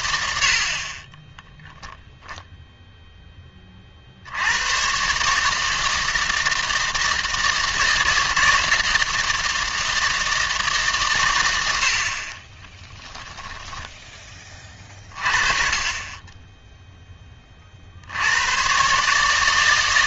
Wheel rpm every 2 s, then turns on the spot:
50, 0, 110, 160, 160, 150, 10, 20, 10, 120.
12-14